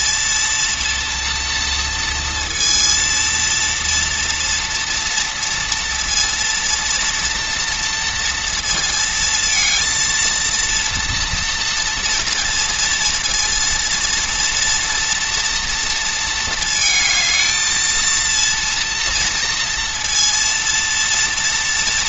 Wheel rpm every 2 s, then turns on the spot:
230, 230, 230, 230, 230, 230, 230, 230, 220, 230, 230.
none